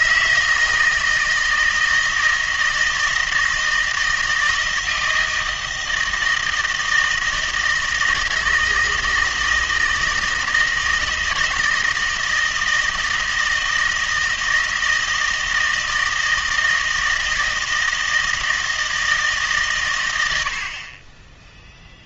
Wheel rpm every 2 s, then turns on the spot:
160, 160, 160, 160, 160, 160, 160, 160, 160, 160, 40.
none